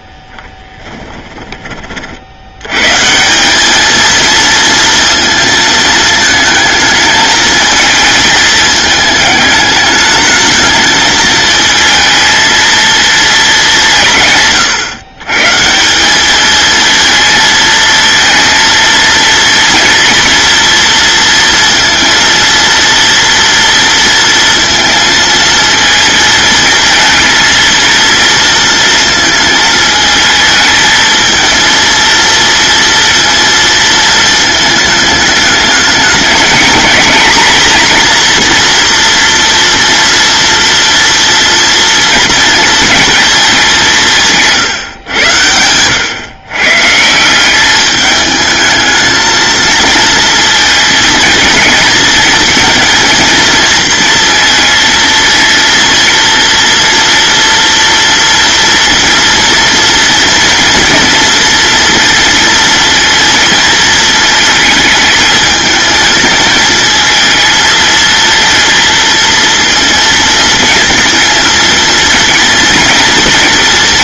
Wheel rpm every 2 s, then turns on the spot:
20, 150, 230, 220, 220, 220, 220, 140, 220, 230, 230, 230, 230, 220, 220, 220, 230, 210, 240, 240, 230, 220, 110, 170, 220, 220, 230, 230, 230, 230, 230, 230, 220, 220, 230, 230, 230.
0-2